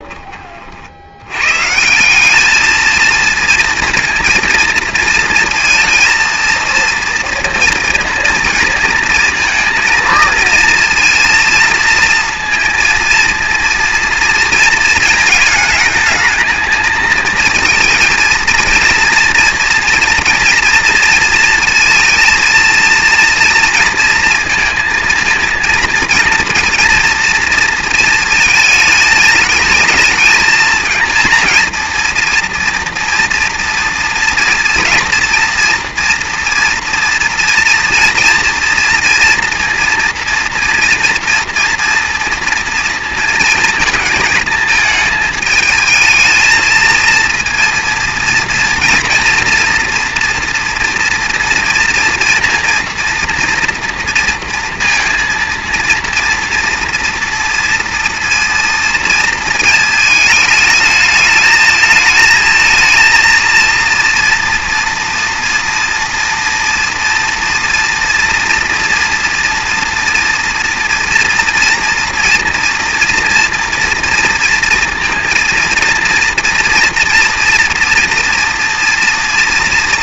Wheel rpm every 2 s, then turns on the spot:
40, 210, 230, 230, 230, 230, 230, 230, 220, 230, 230, 230, 230, 230, 220, 220, 230, 230, 230, 230, 230, 230, 220, 220, 230, 240, 230, 230, 230, 230, 220, 220, 230, 230, 230, 230, 240, 230, 230, 230.
none